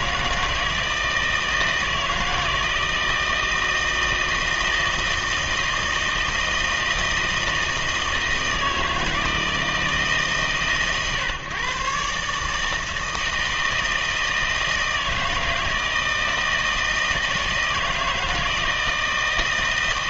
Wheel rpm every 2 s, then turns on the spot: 160, 160, 160, 160, 160, 120, 150, 160, 160, 160.
none